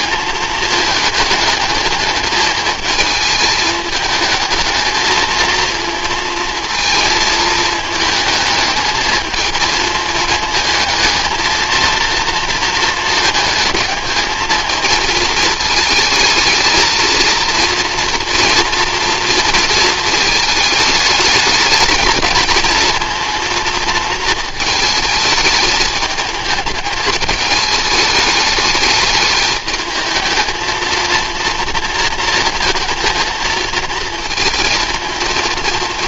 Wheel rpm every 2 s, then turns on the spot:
210, 210, 220, 220, 220, 220, 220, 220, 230, 230, 220, 230, 220, 220, 210, 220, 230, 220.
none